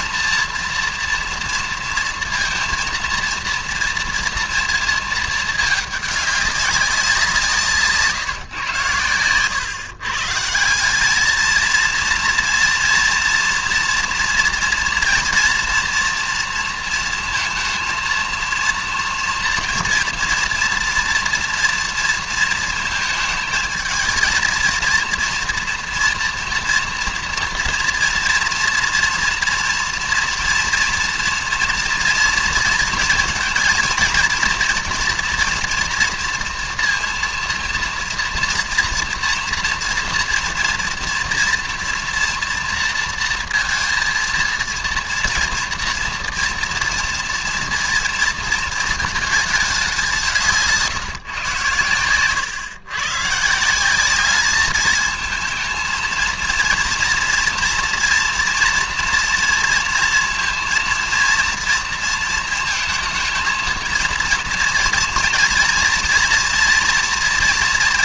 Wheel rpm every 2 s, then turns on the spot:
230, 230, 230, 200, 130, 170, 230, 230, 230, 230, 230, 230, 220, 230, 230, 230, 230, 230, 230, 230, 230, 230, 230, 230, 220, 160, 130, 210, 230, 230, 230, 220, 230, 230.
none